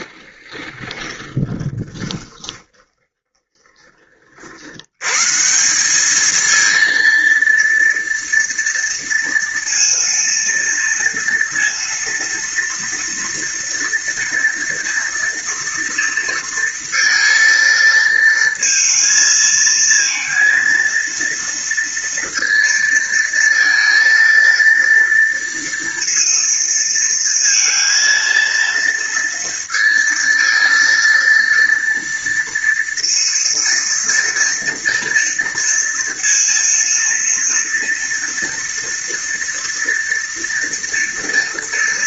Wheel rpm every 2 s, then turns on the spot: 20, 10, 100, 230, 230, 230, 230, 230, 230, 230, 230, 230, 230, 230, 230, 230, 230, 230, 230, 230, 230.
0-4